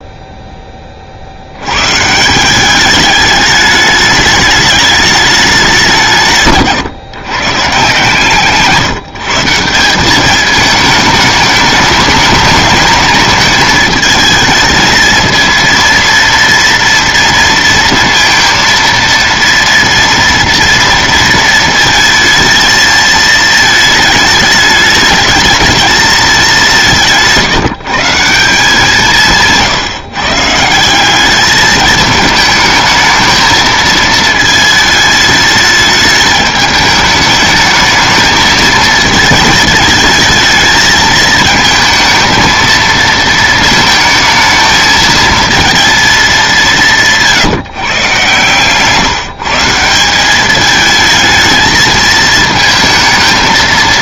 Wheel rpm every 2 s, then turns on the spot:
10, 180, 210, 140, 150, 210, 220, 220, 230, 230, 230, 220, 210, 200, 170, 140, 220, 220, 210, 220, 220, 220, 220, 210, 130, 200, 220.
none